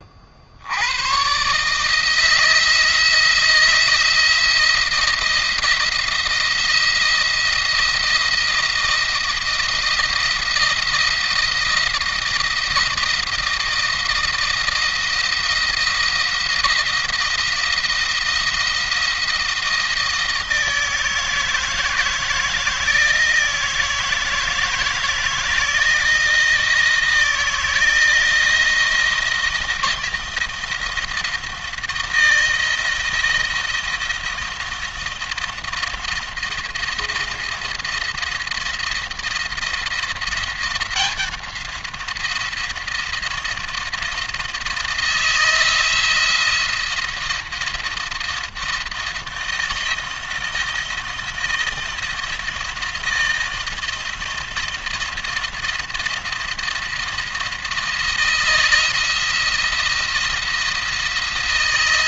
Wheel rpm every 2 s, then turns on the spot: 80, 160, 170, 170, 170, 170, 170, 160, 170, 170, 160, 160, 160, 170, 170, 170, 170, 170, 170, 170, 180, 170, 160, 170, 170, 170, 170, 170, 170, 160, 170.
none